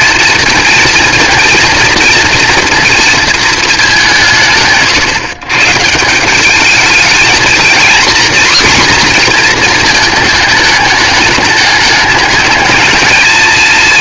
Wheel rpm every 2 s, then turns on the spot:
230, 230, 150, 210, 260, 210, 220.
none